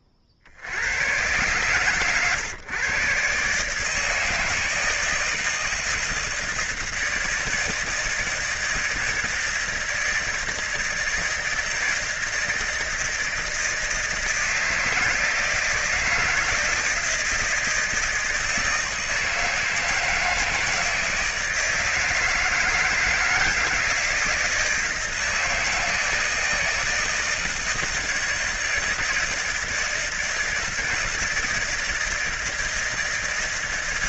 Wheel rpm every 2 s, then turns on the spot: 70, 130, 160, 160, 160, 160, 160, 160, 160, 160, 160, 160, 160, 160, 160, 160, 160.
none